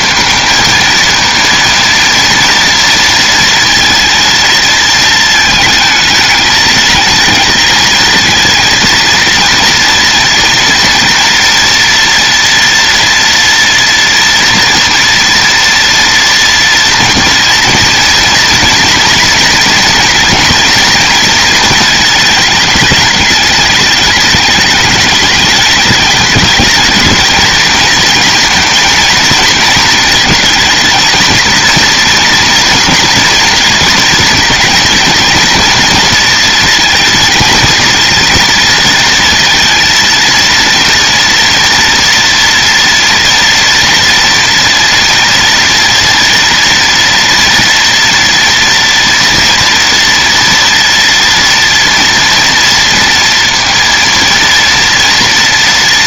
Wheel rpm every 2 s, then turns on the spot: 230, 230, 230, 220, 230, 230, 230, 230, 240, 230, 230, 210, 210, 220, 230, 230, 230, 230, 230, 230, 230, 230, 230, 230, 230, 230, 230, 230.
none